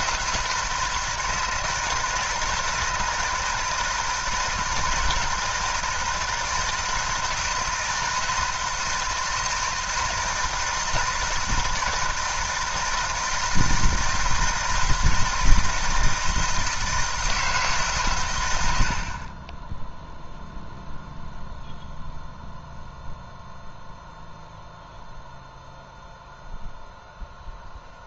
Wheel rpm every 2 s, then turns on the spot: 160, 160, 160, 160, 160, 160, 160, 160, 170, 80, 0, 0, 0, 0.
none